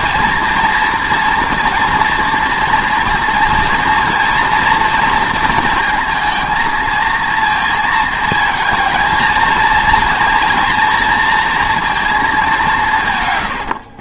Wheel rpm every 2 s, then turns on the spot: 230, 230, 230, 220, 220, 230, 190.
none